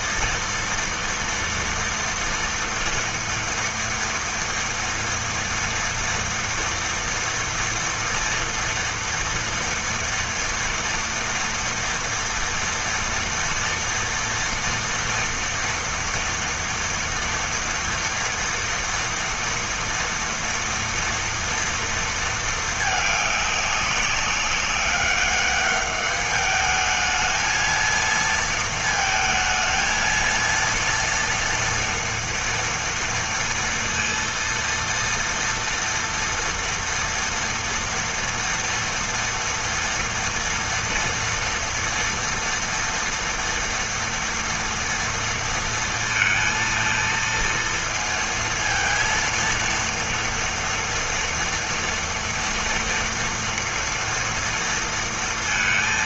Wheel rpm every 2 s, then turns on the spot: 230, 230, 230, 230, 230, 230, 230, 230, 230, 240, 230, 220, 200, 210, 230, 230, 230, 230, 230, 230, 230, 230, 230, 230, 230, 230, 230, 230.
none